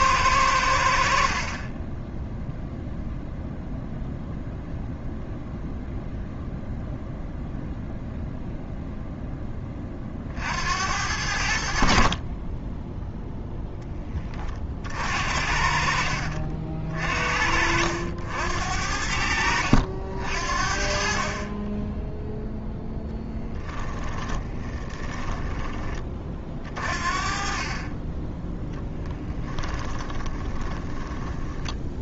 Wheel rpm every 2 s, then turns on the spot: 60, 0, 0, 0, 0, 80, 10, 50, 50, 80, 40, 0, 20, 40, 10, 10.
24-26 28-32